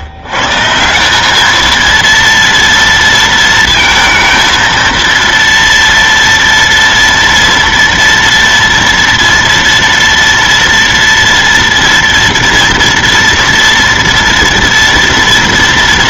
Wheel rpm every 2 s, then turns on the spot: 160, 230, 230, 230, 230, 240, 230, 240.
none